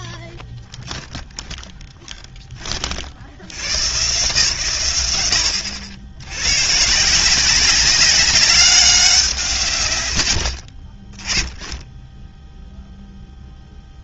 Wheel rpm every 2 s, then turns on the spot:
0, 70, 120, 160, 200, 20, 0.
none